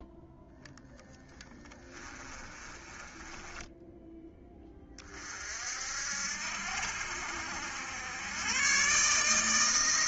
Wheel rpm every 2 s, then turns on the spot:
0, 20, 30, 70, 140.
2-4